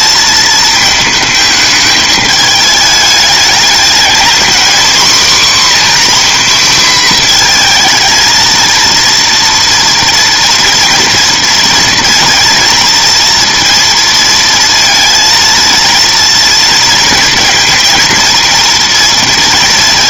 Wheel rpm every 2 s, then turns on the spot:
220, 210, 240, 250, 230, 230, 230, 230, 230, 230.
none